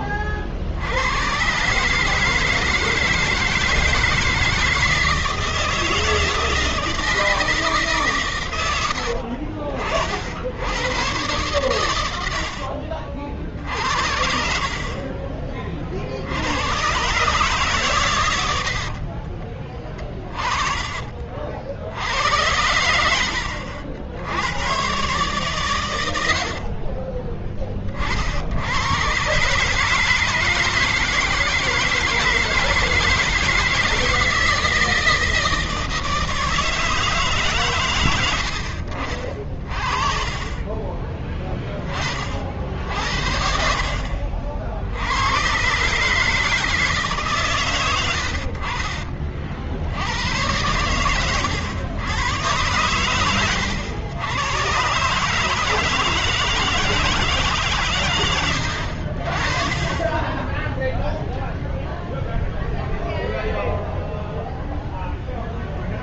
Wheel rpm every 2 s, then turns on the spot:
40, 150, 160, 160, 120, 70, 70, 60, 90, 100, 20, 80, 100, 60, 70, 160, 160, 160, 160, 100, 40, 50, 60, 150, 60, 100, 120, 120, 160, 100, 10, 0, 0.
12-14